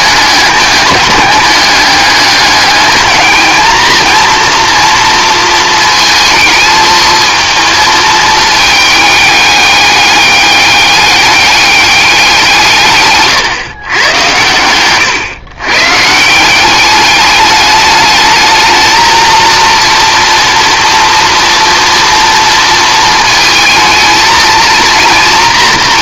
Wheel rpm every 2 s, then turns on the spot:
210, 210, 230, 220, 220, 200, 150, 110, 200, 220, 240, 230, 230.
none